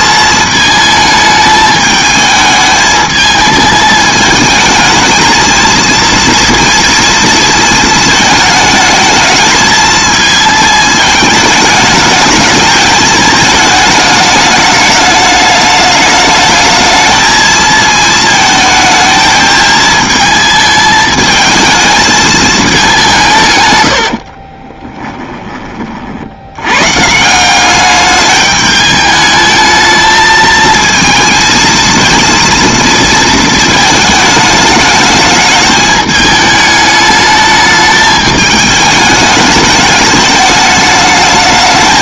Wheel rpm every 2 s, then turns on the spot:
220, 220, 220, 230, 220, 220, 220, 210, 220, 220, 220, 210, 30, 110, 210, 220, 230, 220, 210, 210, 210.
24-26